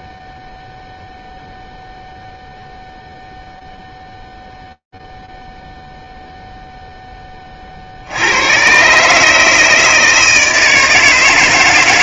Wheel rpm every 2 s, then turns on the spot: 0, 0, 0, 0, 110, 160.
none